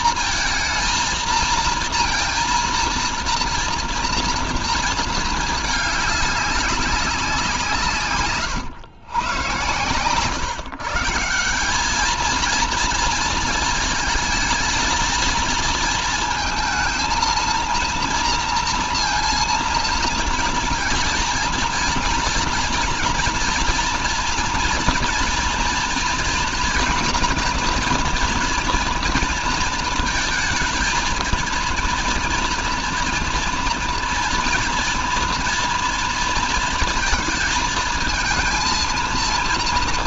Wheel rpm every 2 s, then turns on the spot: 230, 230, 230, 200, 120, 150, 230, 220, 230, 230, 230, 240, 240, 230, 230, 230, 230, 230, 230, 230.
none